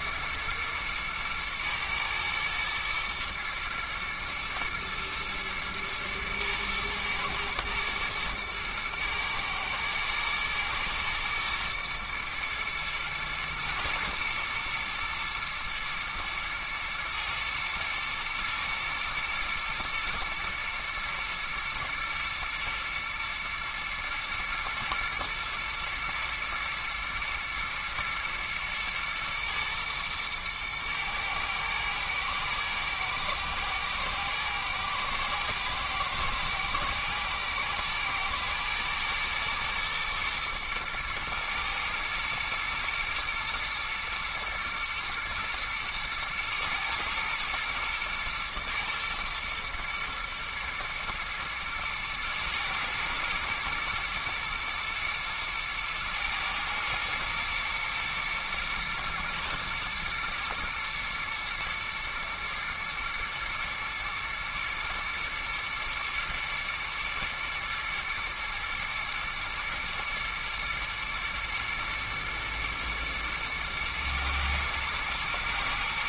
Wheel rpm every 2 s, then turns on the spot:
120, 110, 110, 110, 110, 110, 120, 120, 110, 110, 120, 120, 110, 110, 120, 110, 110, 120, 120, 120, 110, 110, 110, 110, 120, 120, 120, 120, 110, 110, 120, 120, 110, 110, 120, 110, 110, 120.
none